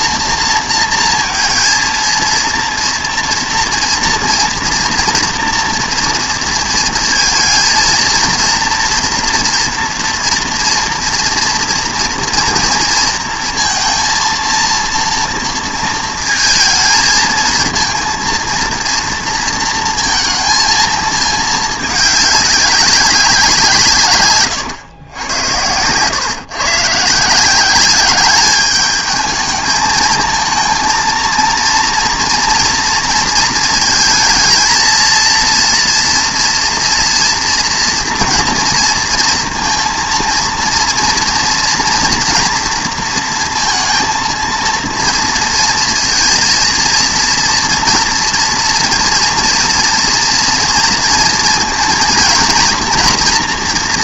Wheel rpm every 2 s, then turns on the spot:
230, 230, 230, 230, 230, 230, 230, 230, 220, 230, 230, 200, 120, 140, 210, 230, 230, 230, 230, 230, 230, 230, 230, 230, 230, 230, 230.
none